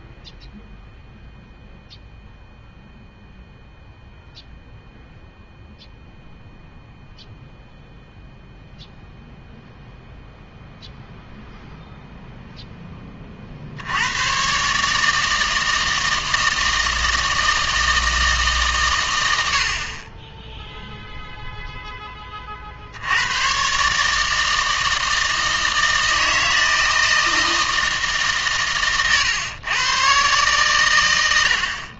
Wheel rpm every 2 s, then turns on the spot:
0, 0, 0, 0, 0, 0, 10, 130, 160, 140, 0, 60, 160, 160, 130, 110.
none